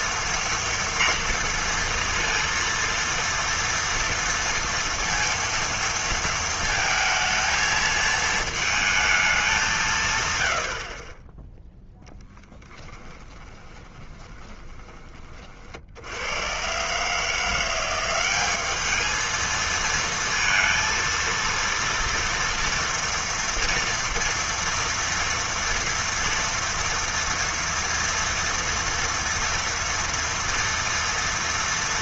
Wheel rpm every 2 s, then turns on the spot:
230, 230, 230, 230, 220, 100, 10, 20, 90, 190, 230, 230, 230, 230, 230, 230.
12-16